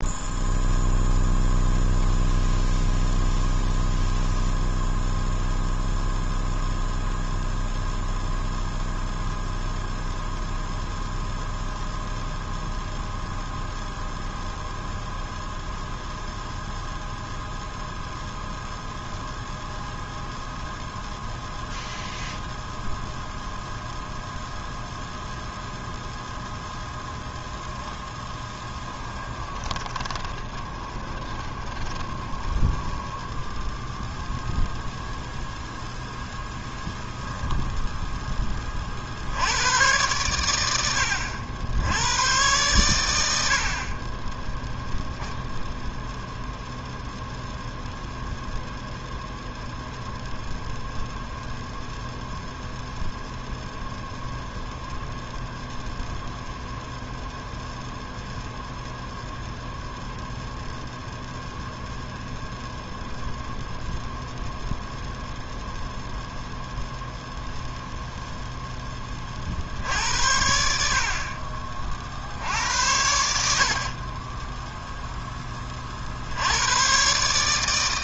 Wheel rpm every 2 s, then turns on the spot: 0, 0, 0, 0, 0, 0, 0, 0, 0, 0, 0, 0, 0, 0, 10, 20, 20, 10, 10, 10, 100, 110, 20, 0, 0, 0, 0, 0, 0, 0, 0, 0, 0, 0, 0, 70, 60, 20, 80.
28-34 74-76